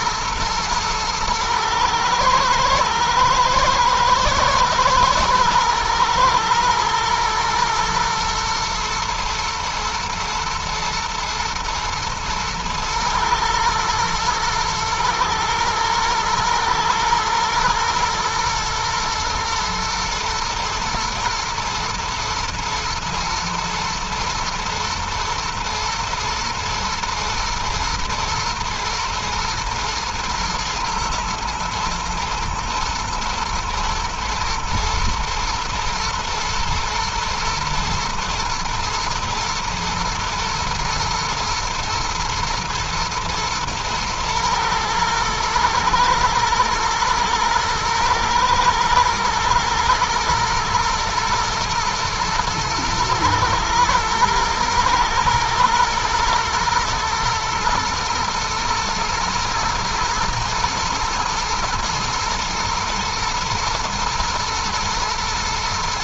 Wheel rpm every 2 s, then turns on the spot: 120, 110, 110, 110, 120, 120, 120, 120, 120, 120, 120, 110, 120, 120, 110, 110, 120, 120, 110, 110, 110, 110, 110, 120, 120, 120, 110, 110, 110, 110, 110, 120, 120.
none